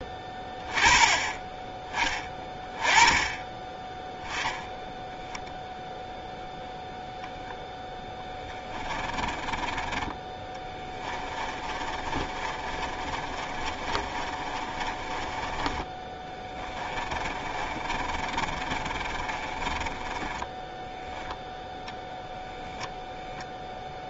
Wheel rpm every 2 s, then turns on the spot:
20, 20, 10, 0, 10, 20, 30, 30, 20, 30, 10, 0.
8-20